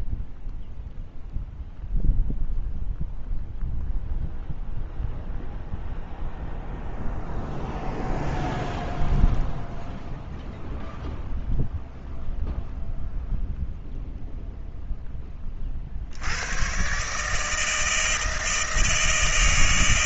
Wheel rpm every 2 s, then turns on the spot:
0, 0, 0, 0, 0, 0, 0, 0, 70, 160.
none